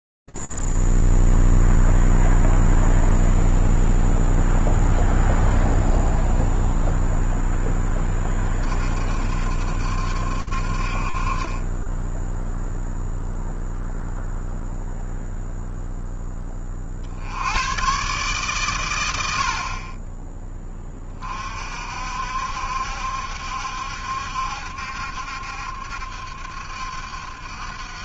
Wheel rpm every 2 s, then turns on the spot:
0, 0, 0, 0, 30, 60, 0, 0, 30, 130, 20, 70, 70, 70.
none